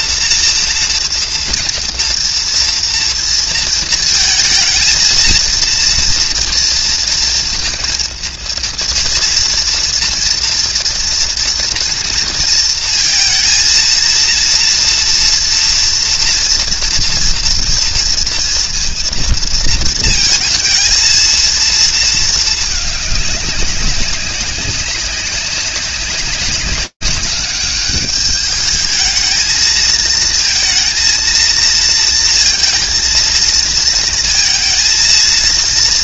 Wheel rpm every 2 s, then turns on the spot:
230, 230, 230, 230, 230, 230, 230, 230, 230, 230, 230, 220, 190, 200, 210, 230, 230, 230.
none